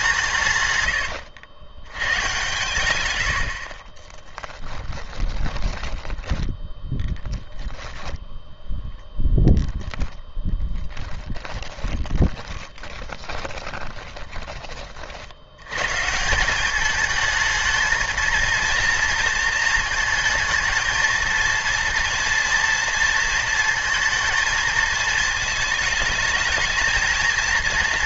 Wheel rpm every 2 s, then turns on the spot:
100, 110, 10, 10, 10, 10, 20, 40, 200, 230, 220, 230, 220, 220.
0-2 4-6 10-14